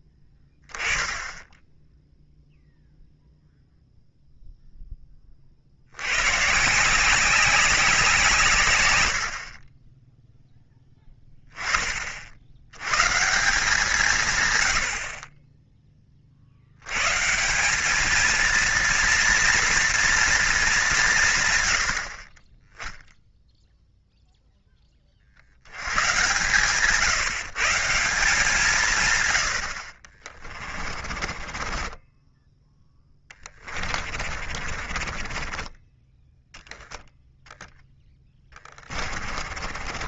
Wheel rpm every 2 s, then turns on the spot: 20, 0, 10, 160, 100, 10, 110, 70, 100, 230, 210, 20, 10, 140, 150, 30, 10, 40, 0, 30.
30-36 38-40